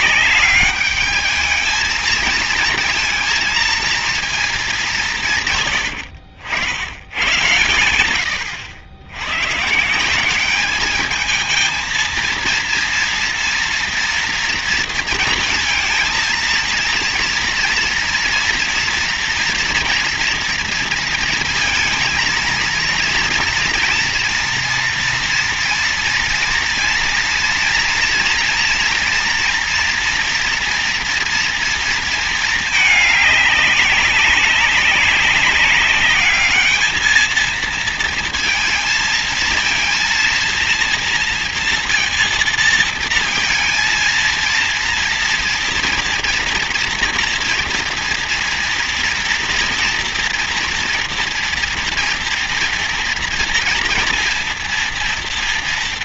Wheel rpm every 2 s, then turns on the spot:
210, 230, 170, 100, 110, 220, 230, 230, 230, 230, 230, 230, 230, 230, 240, 230, 210, 200, 220, 220, 230, 230, 230, 230, 230, 230, 230, 230.
none